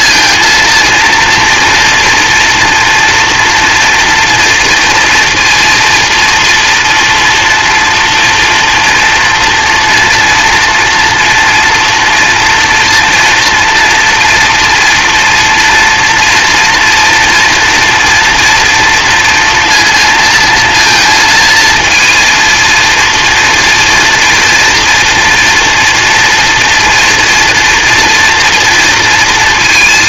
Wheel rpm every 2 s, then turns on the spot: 230, 240, 230, 230, 240, 240, 240, 230, 230, 230, 230, 230, 230, 230, 230.
none